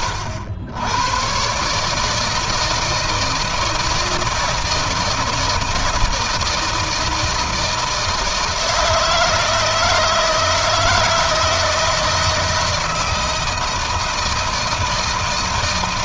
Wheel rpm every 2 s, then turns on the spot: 100, 160, 160, 160, 160, 160, 160, 160.
none